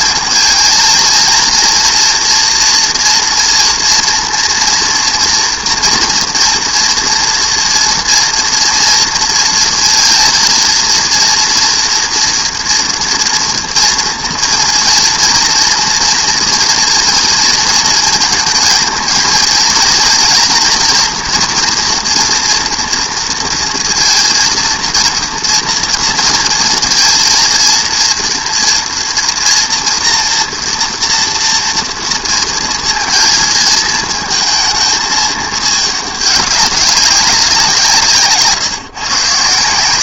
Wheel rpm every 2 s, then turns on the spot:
230, 230, 230, 230, 230, 230, 240, 230, 240, 230, 230, 230, 230, 230, 230, 230, 230, 220, 200, 150.
none